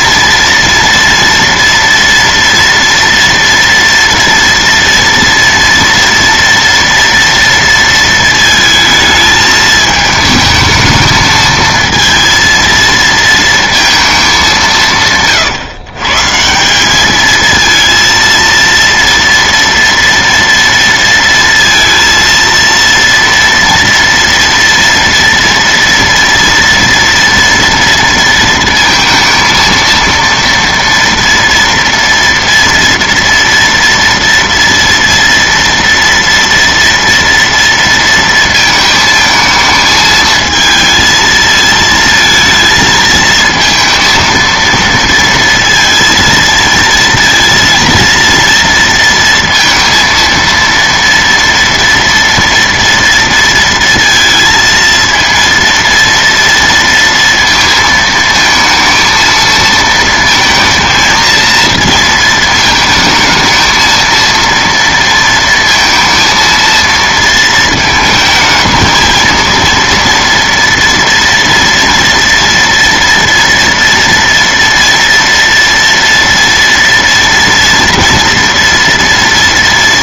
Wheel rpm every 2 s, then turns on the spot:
230, 230, 230, 230, 220, 220, 230, 160, 190, 230, 230, 230, 230, 230, 230, 230, 230, 230, 230, 220, 220, 220, 230, 230, 230, 230, 230, 230, 230, 220, 230, 220, 230, 230, 220, 230, 230, 230, 230, 230.
none